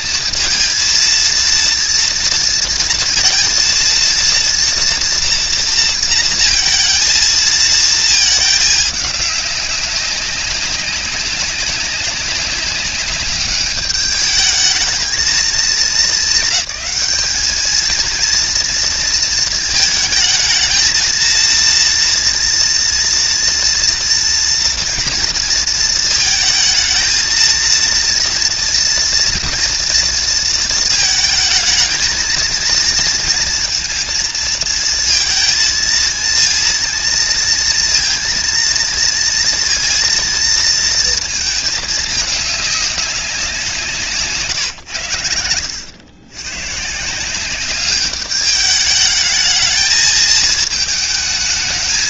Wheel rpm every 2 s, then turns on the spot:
230, 230, 230, 230, 210, 200, 200, 220, 210, 230, 230, 230, 230, 220, 230, 230, 230, 220, 230, 230, 230, 200, 120, 140, 210, 220.
none